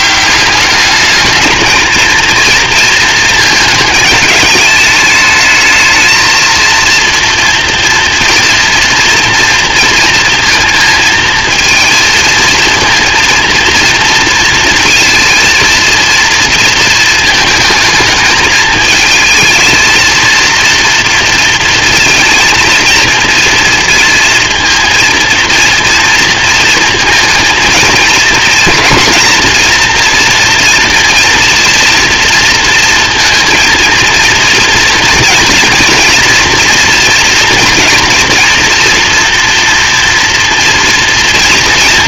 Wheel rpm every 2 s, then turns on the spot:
210, 220, 210, 230, 230, 230, 230, 230, 220, 220, 230, 230, 230, 230, 230, 240, 230, 230, 240, 230, 230.
none